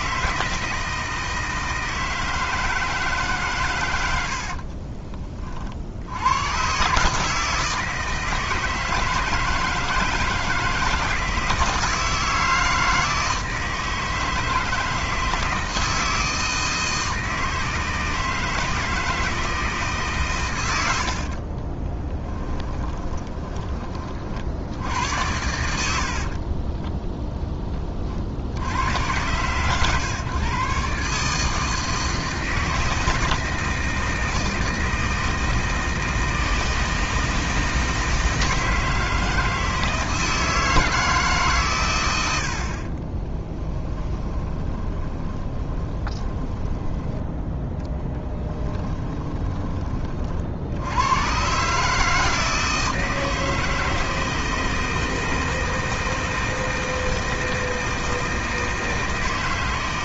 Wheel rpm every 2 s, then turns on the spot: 160, 160, 40, 130, 160, 160, 160, 160, 160, 160, 90, 20, 80, 20, 100, 140, 160, 160, 160, 160, 160, 50, 20, 10, 10, 80, 160, 160, 160, 160.
4-6 22-24 26-28 44-50